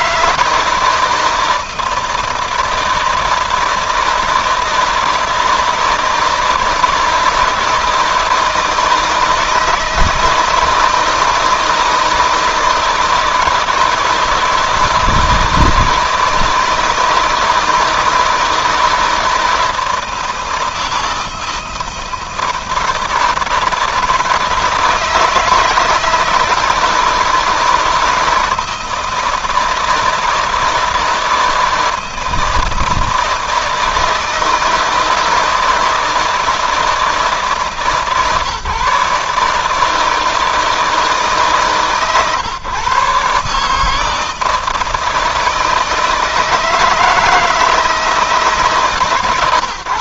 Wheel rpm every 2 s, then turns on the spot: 160, 160, 160, 160, 160, 160, 160, 160, 160, 170, 160, 160, 160, 160, 160, 160, 160, 160, 160, 150, 160, 140, 160, 160, 140.
none